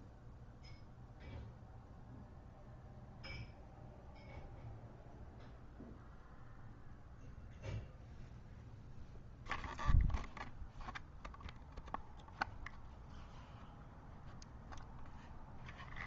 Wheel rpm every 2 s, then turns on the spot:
0, 0, 0, 0, 0, 0, 0, 0.
none